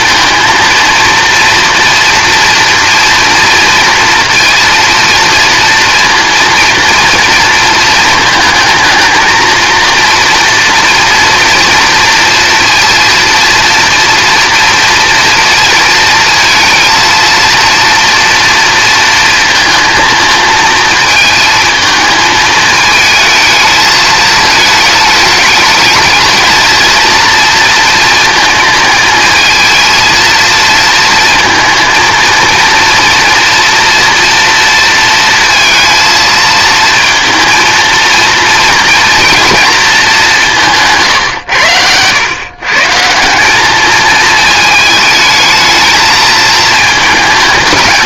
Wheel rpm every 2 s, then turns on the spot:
230, 230, 230, 230, 230, 240, 230, 230, 230, 230, 220, 220, 210, 230, 220, 230, 230, 230, 220, 230, 150, 150, 220, 220.
none